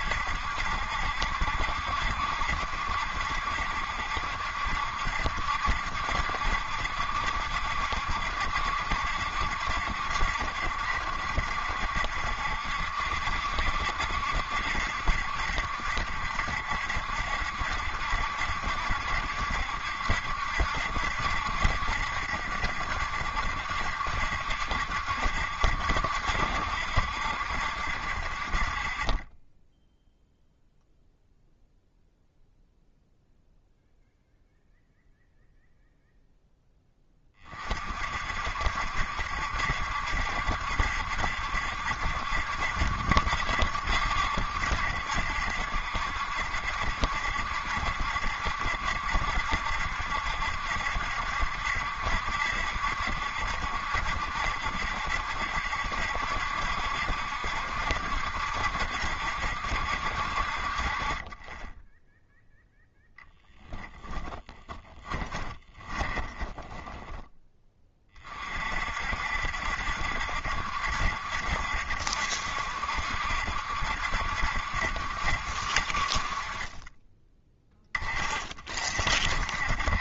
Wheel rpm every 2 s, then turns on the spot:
70, 60, 70, 70, 70, 70, 70, 70, 70, 70, 70, 70, 60, 60, 40, 0, 0, 0, 10, 60, 70, 70, 70, 70, 70, 70, 70, 60, 70, 70, 50, 0, 10, 20, 40, 70, 70, 70, 30, 40.
64-68